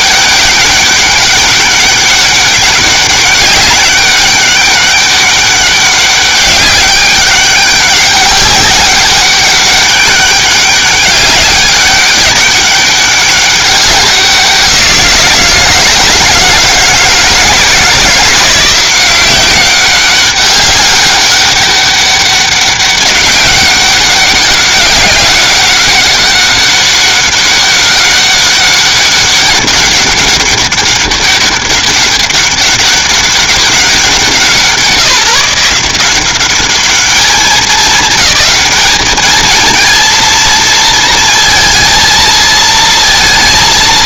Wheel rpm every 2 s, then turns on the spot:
200, 200, 200, 200, 200, 200, 200, 170, 160, 180, 200, 200, 200, 200, 200, 200, 200, 170, 210, 220, 230, 230.
none